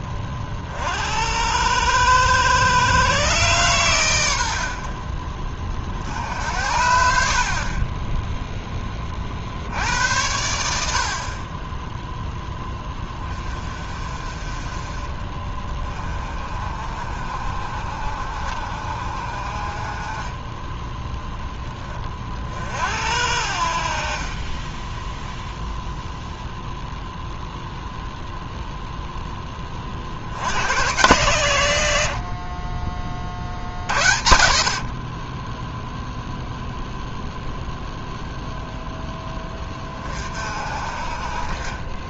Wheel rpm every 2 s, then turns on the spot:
40, 110, 50, 70, 20, 70, 20, 30, 40, 50, 10, 60, 10, 0, 0, 110, 30, 50, 0, 0, 40.
24-26